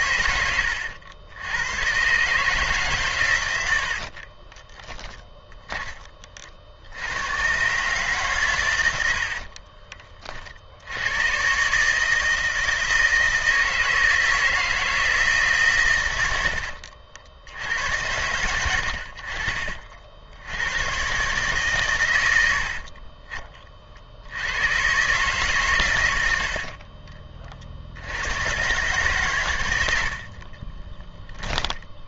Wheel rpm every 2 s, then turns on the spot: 110, 140, 20, 60, 110, 70, 160, 160, 70, 80, 90, 70, 100, 60, 110, 20.
4-6 16-18 26-28 30-32